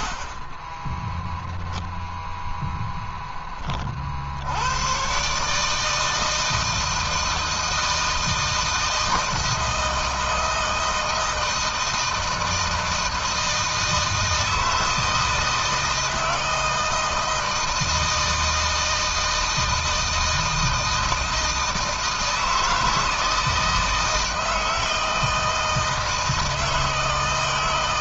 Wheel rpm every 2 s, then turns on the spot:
0, 10, 130, 160, 160, 160, 160, 160, 160, 160, 160, 160, 160, 160.
none